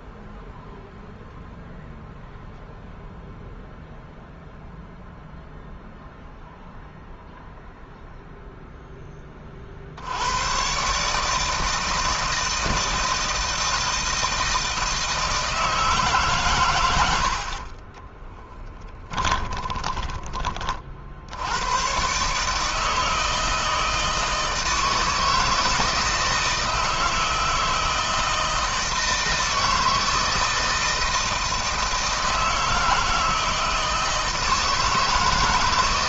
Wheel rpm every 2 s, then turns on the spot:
0, 0, 0, 0, 10, 130, 160, 160, 90, 20, 50, 160, 160, 160, 160, 160, 160, 160.
18-20